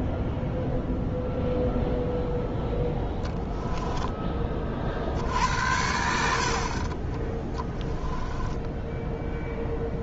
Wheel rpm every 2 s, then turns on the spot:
0, 0, 50, 30, 10.
none